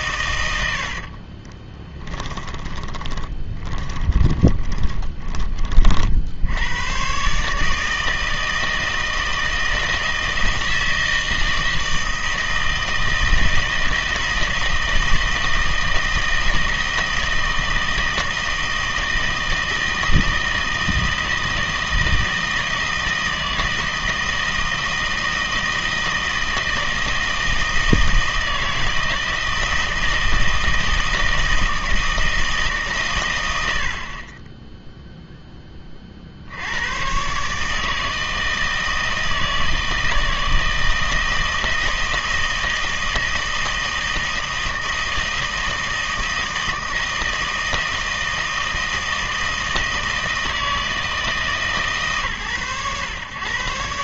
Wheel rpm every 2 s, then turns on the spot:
80, 10, 20, 100, 160, 160, 160, 160, 160, 160, 160, 160, 160, 160, 160, 160, 150, 10, 90, 160, 160, 160, 160, 160, 160, 160, 120.
0-6